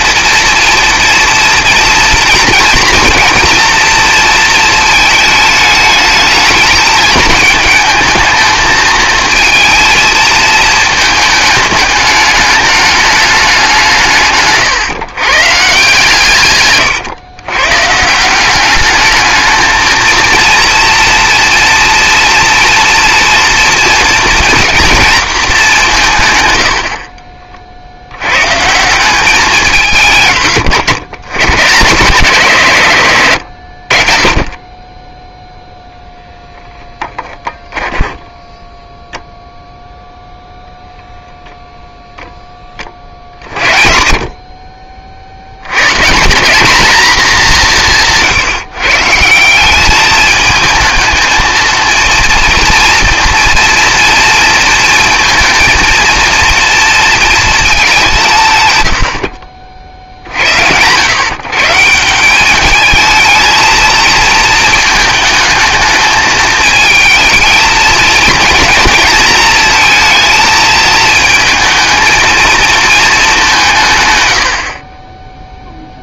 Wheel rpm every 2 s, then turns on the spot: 240, 240, 220, 210, 220, 220, 210, 140, 140, 200, 230, 230, 230, 90, 150, 110, 140, 30, 10, 10, 0, 20, 50, 220, 140, 220, 230, 230, 230, 120, 80, 210, 220, 220, 230, 220, 220, 60.
16-18 38-40